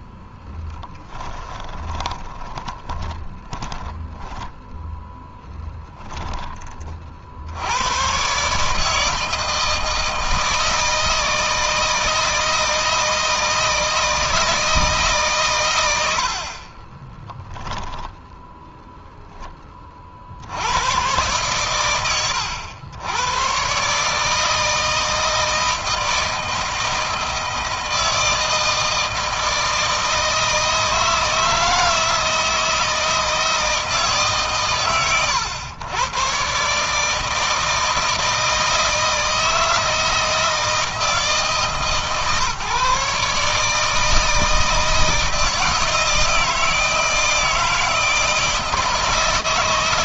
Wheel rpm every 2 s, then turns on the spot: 10, 20, 10, 40, 150, 160, 160, 150, 10, 0, 100, 90, 160, 160, 160, 160, 160, 130, 150, 160, 160, 150, 160, 160, 160.
0-4 16-18